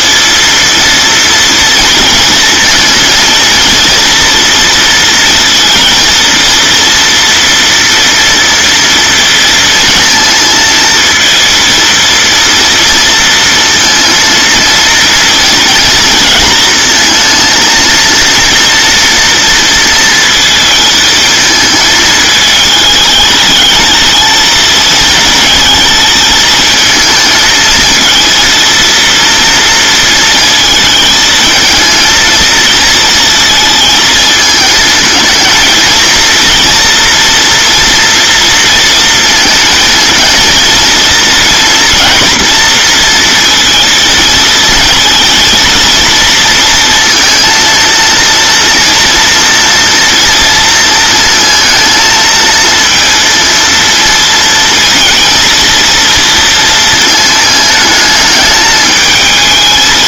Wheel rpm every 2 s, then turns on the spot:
230, 230, 230, 230, 230, 230, 230, 230, 230, 230, 220, 210, 220, 220, 230, 220, 220, 220, 230, 230, 230, 230, 230, 230, 230, 230, 230, 230, 230, 220.
none